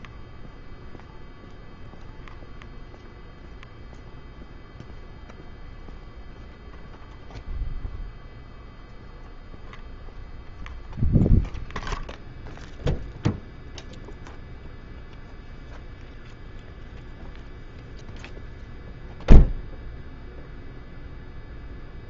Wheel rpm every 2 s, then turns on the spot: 0, 0, 0, 0, 0, 0, 0, 0, 0, 0, 0.
none